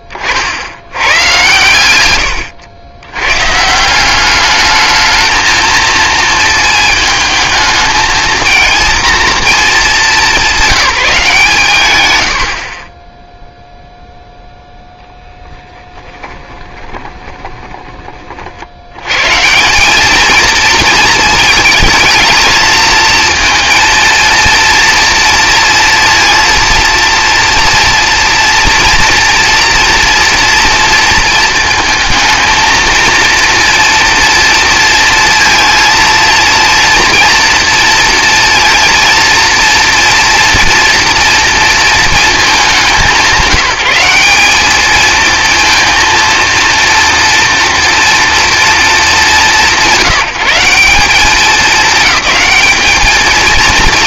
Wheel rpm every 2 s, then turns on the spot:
60, 110, 210, 220, 230, 190, 50, 10, 10, 60, 220, 230, 230, 230, 230, 230, 230, 230, 230, 230, 240, 190, 210, 230, 210, 180, 210.
16-18